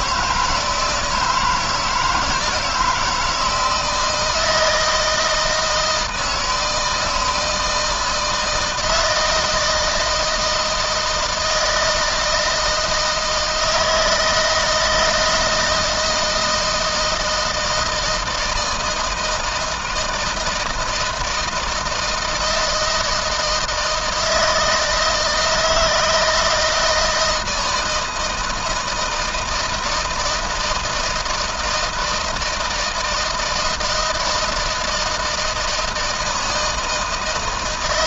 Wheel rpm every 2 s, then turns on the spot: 170, 160, 160, 160, 160, 160, 160, 160, 160, 160, 160, 160, 160, 160, 160, 160, 160, 160, 160.
none